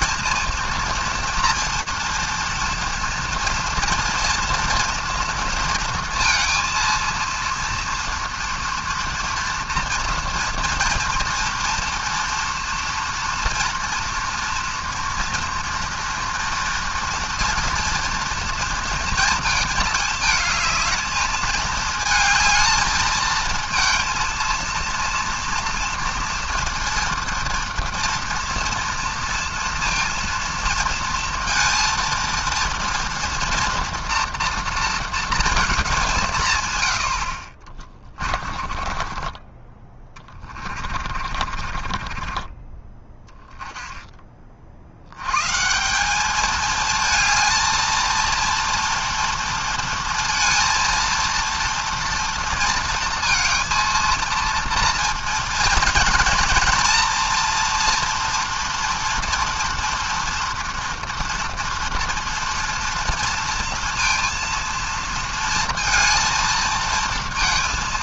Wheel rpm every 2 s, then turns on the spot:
230, 230, 230, 230, 230, 230, 230, 240, 230, 230, 220, 220, 230, 230, 230, 230, 230, 230, 120, 30, 40, 30, 30, 220, 230, 230, 230, 230, 240, 230, 230, 230, 230, 230.
38-44